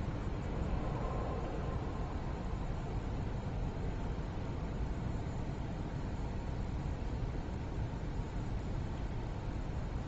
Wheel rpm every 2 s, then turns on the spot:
0, 0, 0, 0, 0.
none